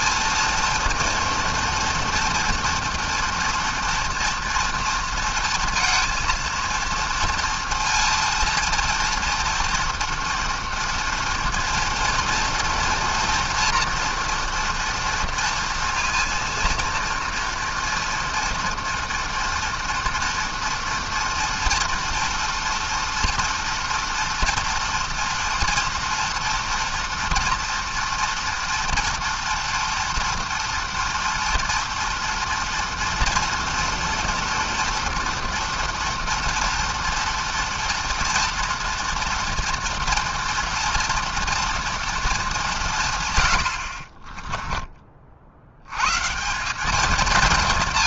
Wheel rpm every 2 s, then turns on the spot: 230, 230, 230, 230, 230, 230, 240, 240, 230, 230, 230, 230, 230, 230, 240, 240, 230, 230, 230, 230, 230, 190, 30, 190.
44-46